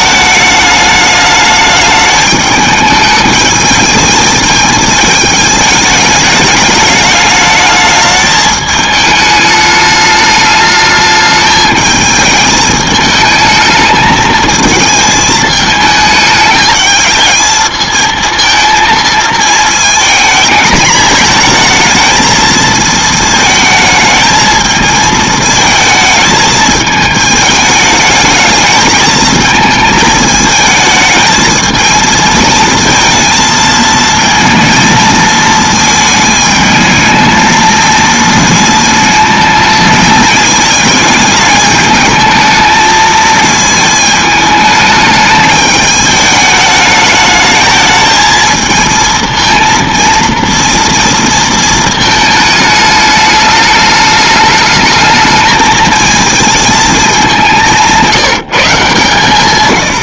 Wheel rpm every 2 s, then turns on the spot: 210, 210, 220, 210, 210, 210, 220, 220, 210, 220, 220, 220, 220, 220, 220, 220, 220, 220, 220, 220, 220, 220, 210, 210, 220, 230, 210, 220, 220, 150.
none